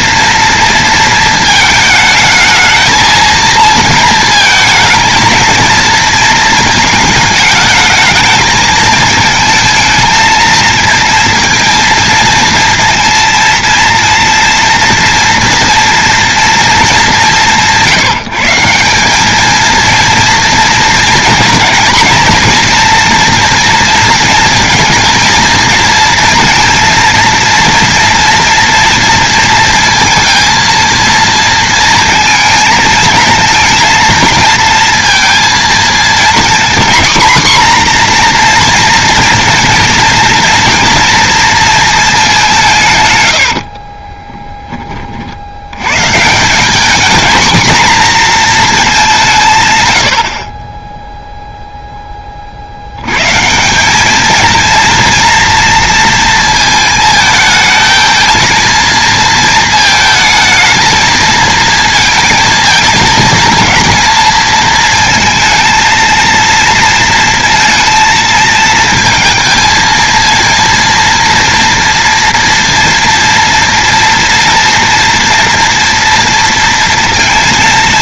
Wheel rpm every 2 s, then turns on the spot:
230, 220, 220, 220, 220, 220, 230, 230, 180, 200, 230, 240, 230, 230, 230, 230, 220, 230, 250, 240, 230, 140, 40, 220, 200, 10, 100, 230, 220, 230, 220, 220, 220, 230, 220, 230, 230, 230, 230.
none